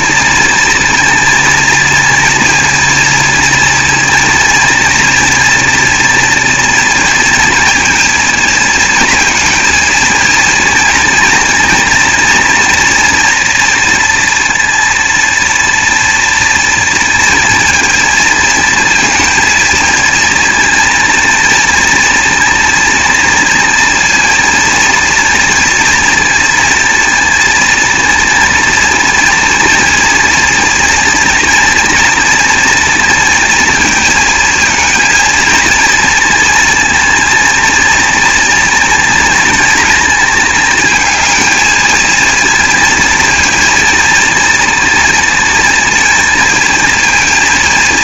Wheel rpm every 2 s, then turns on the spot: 230, 230, 230, 230, 230, 220, 230, 230, 230, 230, 230, 230, 230, 230, 230, 230, 230, 220, 230, 230, 220, 230, 230, 220.
none